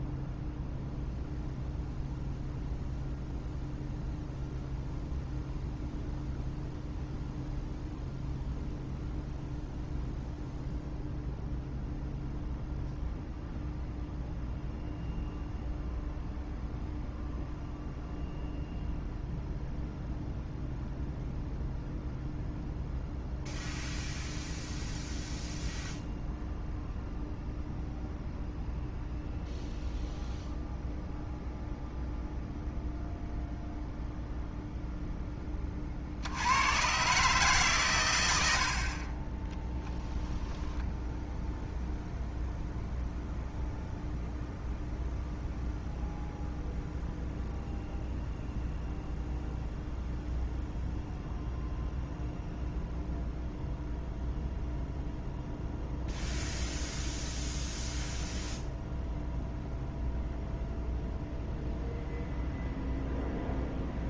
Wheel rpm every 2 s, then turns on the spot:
0, 0, 0, 0, 0, 0, 0, 0, 0, 0, 0, 0, 0, 0, 0, 0, 0, 0, 110, 60, 0, 0, 0, 0, 0, 0, 0, 0, 0, 0, 0, 0.
38-40